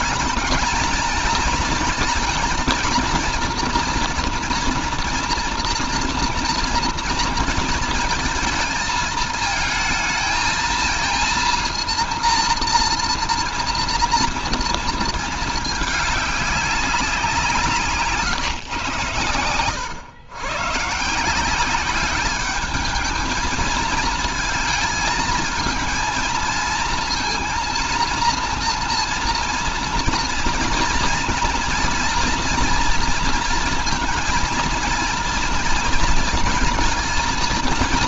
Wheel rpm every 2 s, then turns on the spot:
220, 230, 230, 230, 230, 230, 230, 230, 190, 120, 130, 210, 220, 230, 230, 230, 230, 220, 230.
none